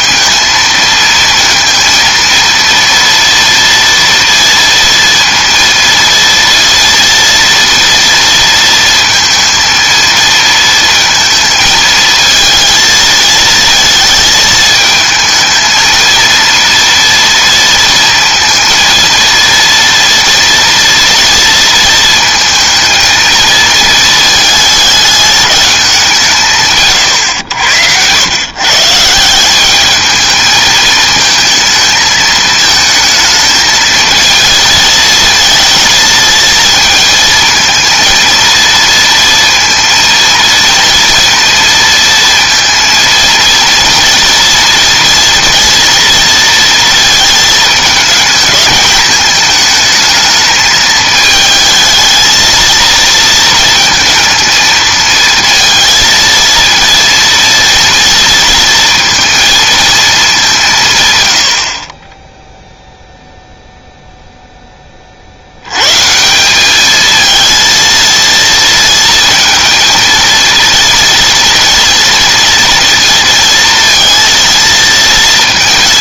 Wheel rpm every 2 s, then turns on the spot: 220, 230, 230, 230, 230, 230, 230, 220, 230, 230, 230, 230, 210, 150, 130, 220, 220, 220, 220, 230, 230, 230, 240, 230, 210, 220, 220, 220, 230, 230, 190, 0, 10, 190, 230, 230, 230, 230.
none